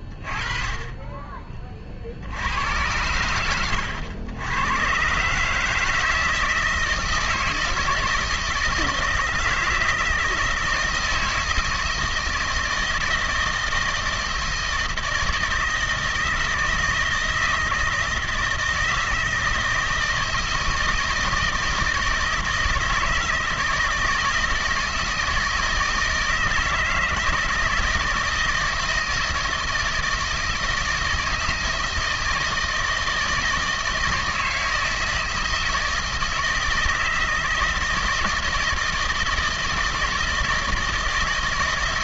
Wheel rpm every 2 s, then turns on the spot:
30, 90, 100, 160, 170, 160, 160, 160, 160, 160, 160, 160, 160, 160, 160, 160, 160, 160, 160, 160, 160.
none